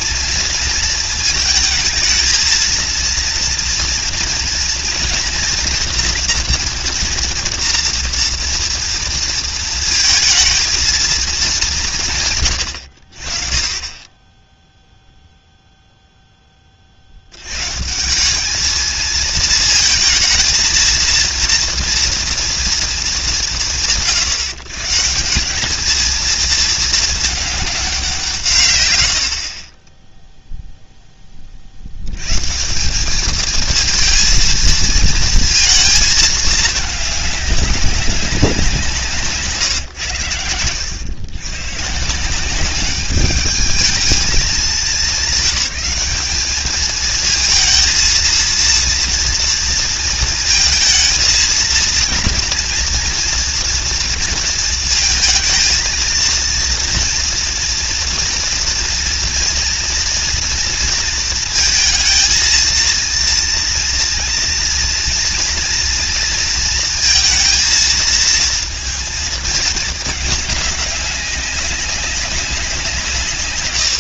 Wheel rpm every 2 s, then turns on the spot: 230, 220, 230, 230, 230, 230, 130, 10, 0, 160, 230, 230, 130, 220, 200, 20, 50, 220, 220, 200, 140, 140, 210, 200, 230, 230, 230, 230, 230, 230, 230, 230, 230, 230, 220, 220, 200.
none